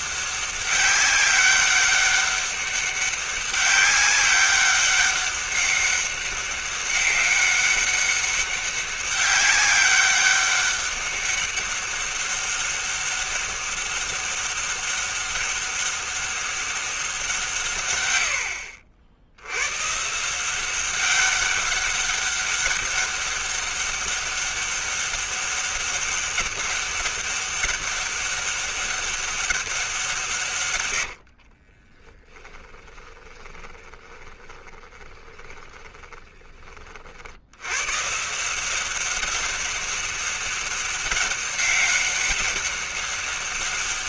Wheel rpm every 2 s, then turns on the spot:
200, 200, 200, 200, 200, 200, 200, 190, 200, 80, 170, 200, 200, 200, 200, 130, 20, 20, 20, 170, 200, 190.
32-36